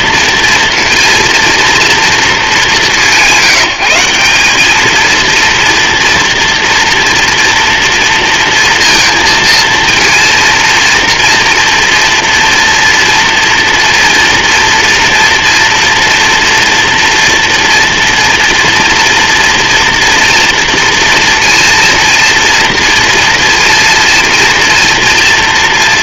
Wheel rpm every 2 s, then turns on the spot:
230, 210, 200, 230, 230, 230, 230, 230, 230, 230, 230, 230, 230.
none